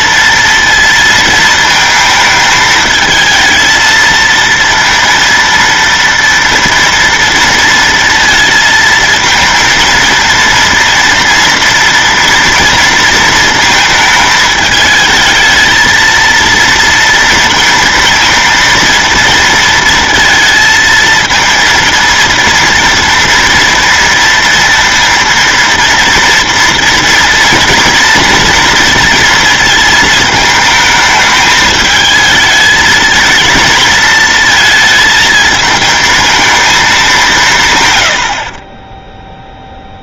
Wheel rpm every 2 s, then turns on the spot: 230, 220, 230, 230, 220, 230, 230, 220, 230, 230, 230, 230, 230, 230, 230, 220, 220, 230, 220, 40.
none